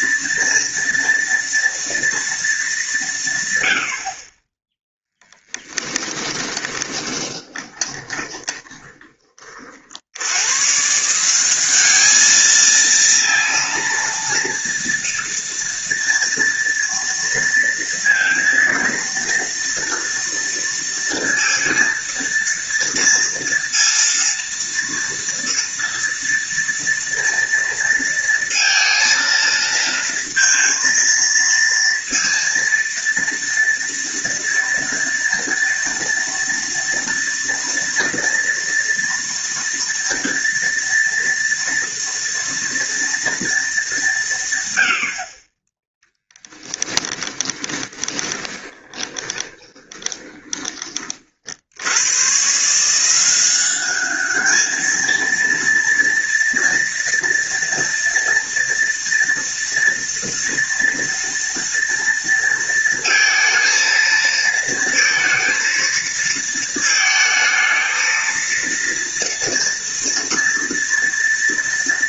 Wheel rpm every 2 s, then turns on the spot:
230, 190, 0, 20, 20, 160, 230, 230, 230, 230, 230, 230, 230, 230, 230, 230, 230, 230, 230, 230, 230, 230, 80, 20, 20, 30, 160, 220, 230, 230, 230, 230, 230, 230, 230, 230.
6-10 46-50